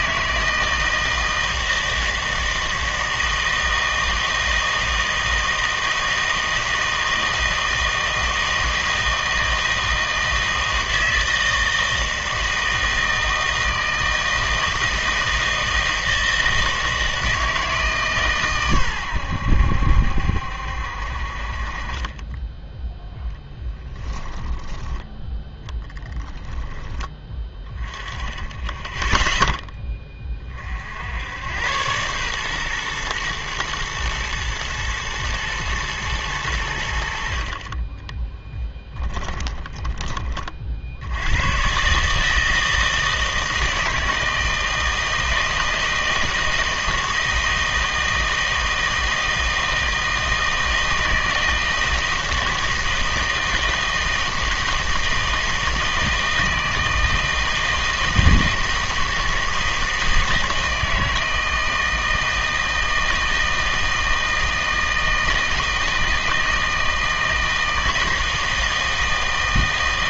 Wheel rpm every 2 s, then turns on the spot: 160, 160, 160, 160, 160, 160, 160, 160, 160, 130, 70, 10, 10, 10, 10, 40, 120, 110, 90, 10, 50, 160, 160, 160, 160, 160, 160, 160, 160, 160, 160, 160, 160, 160, 160.
24-26 38-40